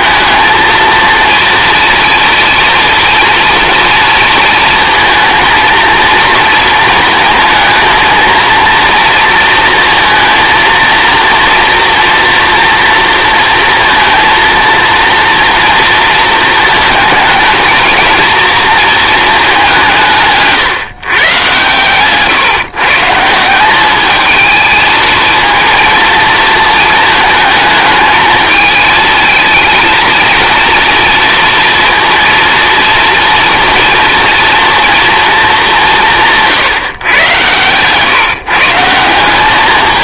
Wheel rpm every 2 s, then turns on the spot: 220, 230, 230, 230, 230, 230, 230, 230, 230, 230, 160, 140, 220, 220, 220, 230, 230, 230, 150, 160.
none